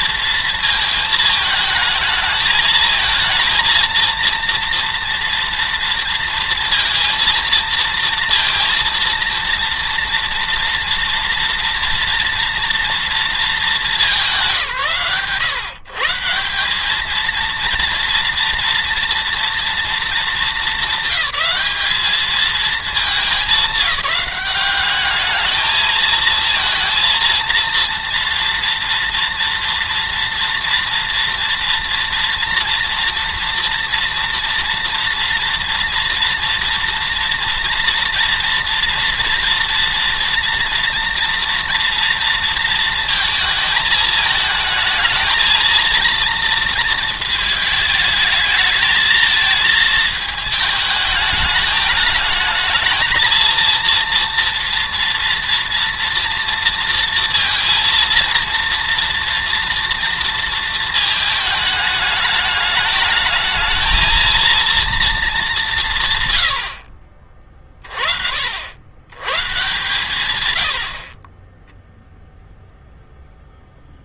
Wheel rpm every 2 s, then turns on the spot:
220, 220, 230, 230, 230, 230, 230, 140, 210, 230, 200, 210, 200, 230, 230, 230, 240, 230, 230, 230, 230, 220, 220, 230, 220, 220, 220, 230, 230, 230, 220, 210, 220, 50, 110, 50, 0.
none